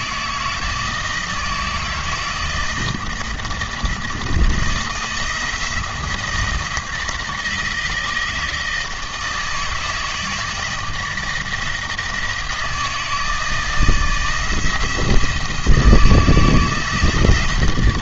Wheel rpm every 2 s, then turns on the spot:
160, 160, 160, 160, 160, 160, 160, 160, 150.
none